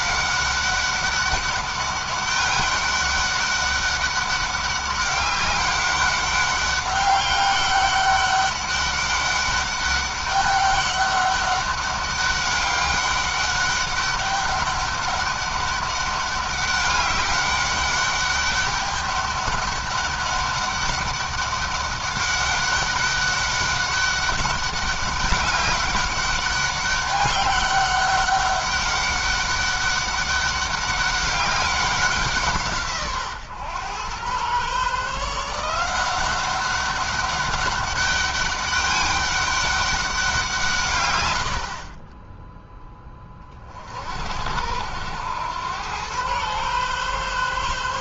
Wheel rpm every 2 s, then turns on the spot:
200, 200, 200, 200, 200, 200, 200, 200, 200, 200, 200, 200, 200, 200, 200, 200, 140, 140, 200, 200, 130, 10, 80, 130.
none